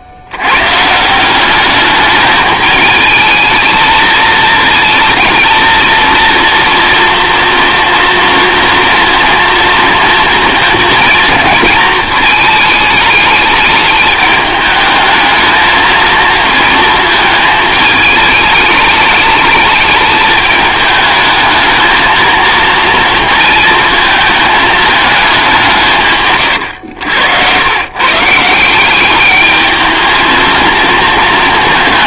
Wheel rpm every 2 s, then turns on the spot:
120, 220, 230, 240, 230, 230, 220, 210, 230, 210, 210, 220, 220, 120, 170, 230.
none